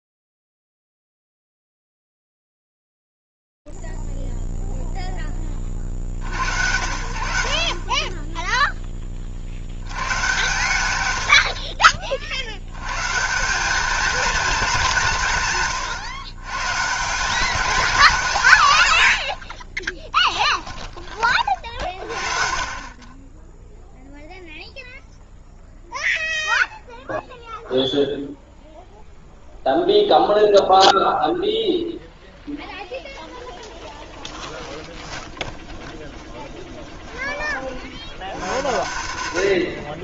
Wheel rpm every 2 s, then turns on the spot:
20, 60, 0, 40, 30, 100, 50, 210, 140, 180, 20, 50, 0, 0, 0, 0, 0, 10, 10, 100.
12-14 20-22 36-38